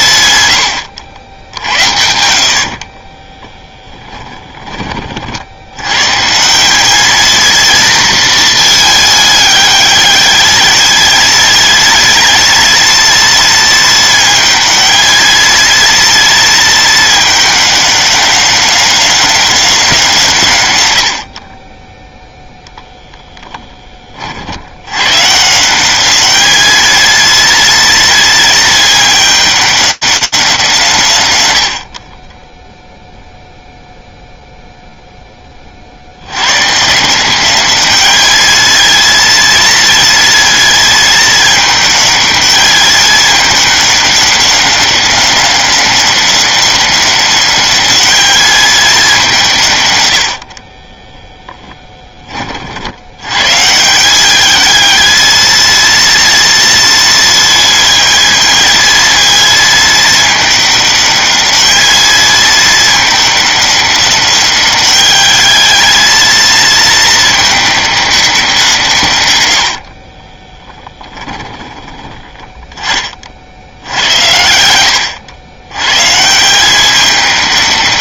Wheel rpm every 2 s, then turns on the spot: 110, 50, 20, 190, 220, 220, 230, 220, 220, 200, 120, 0, 80, 220, 220, 180, 10, 0, 140, 220, 220, 210, 190, 200, 200, 20, 90, 220, 230, 220, 210, 210, 210, 220, 140, 10, 30, 90, 200.
2-4 50-52 70-72